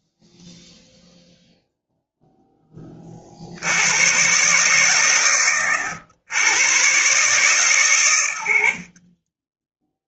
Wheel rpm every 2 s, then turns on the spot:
0, 40, 130, 130, 40.
none